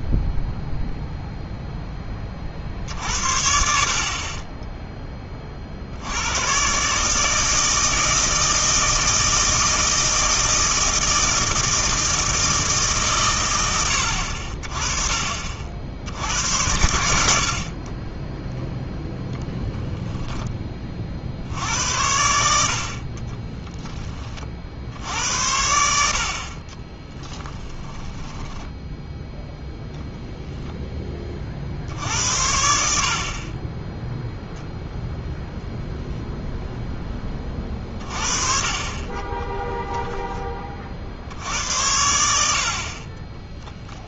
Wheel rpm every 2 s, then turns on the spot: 0, 50, 10, 120, 160, 160, 160, 50, 90, 0, 20, 70, 50, 40, 10, 0, 80, 0, 0, 30, 30, 70.
28-30